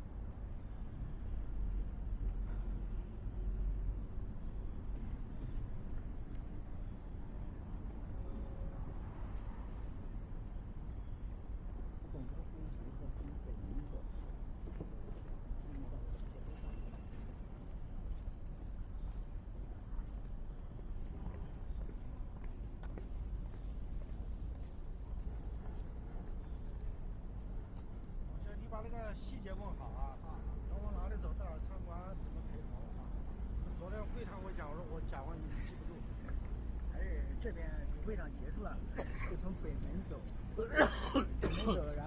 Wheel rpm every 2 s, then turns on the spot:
0, 0, 0, 0, 0, 0, 0, 0, 0, 0, 0, 0, 0, 0, 0, 0, 0, 0, 0, 0, 0.
none